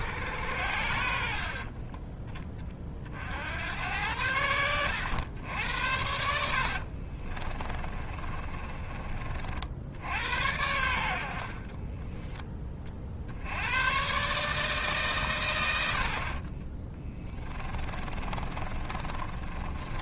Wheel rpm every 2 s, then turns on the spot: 80, 40, 100, 60, 30, 90, 40, 140, 20, 30.
6-8 16-20